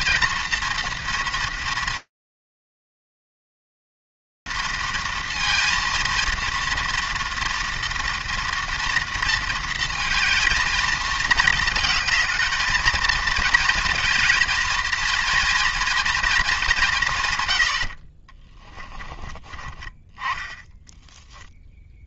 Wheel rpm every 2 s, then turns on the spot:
230, 230, 230, 230, 220, 230, 230, 160, 20, 0, 0.
none